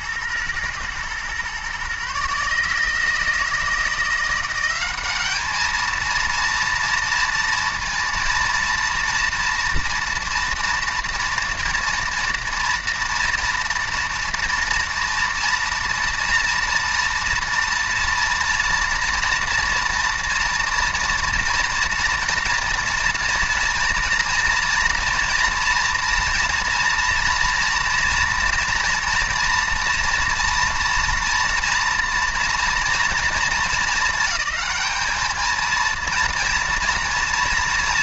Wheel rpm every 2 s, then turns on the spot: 120, 150, 190, 230, 230, 230, 240, 230, 230, 230, 230, 230, 230, 230, 230, 230, 230, 210, 230.
none